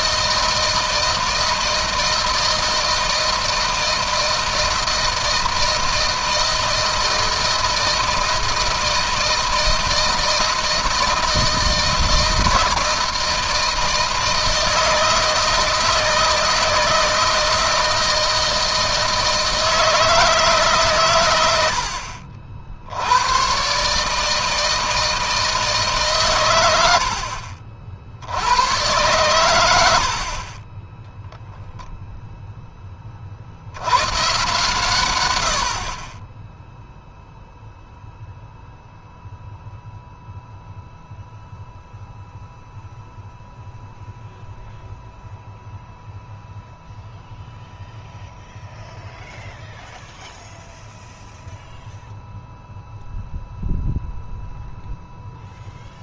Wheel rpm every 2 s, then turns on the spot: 160, 160, 160, 160, 160, 160, 160, 160, 160, 160, 150, 90, 160, 100, 110, 20, 10, 130, 10, 0, 0, 0, 0, 0, 0, 0, 0, 0.
none